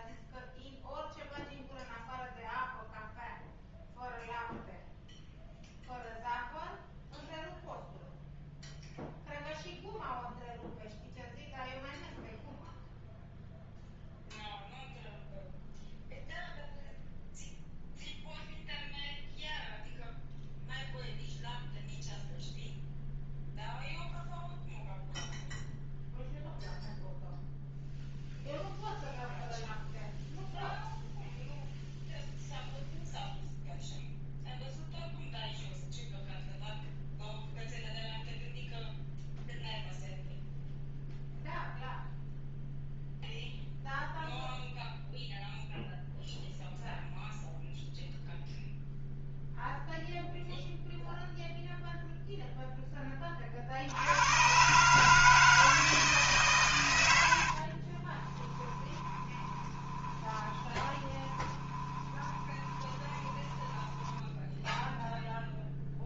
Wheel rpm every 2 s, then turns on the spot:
0, 0, 0, 0, 0, 0, 0, 0, 0, 0, 0, 0, 0, 0, 0, 0, 0, 0, 0, 0, 0, 0, 0, 0, 0, 0, 0, 120, 120, 20, 20, 20, 0.
58-64